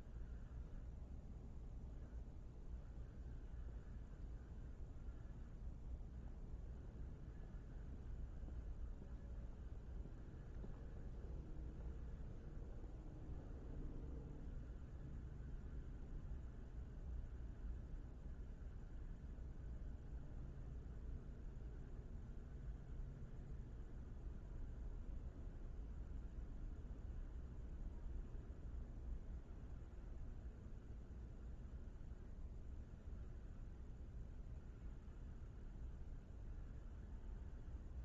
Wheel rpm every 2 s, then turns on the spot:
0, 0, 0, 0, 0, 0, 0, 0, 0, 0, 0, 0, 0, 0, 0, 0, 0, 0, 0.
none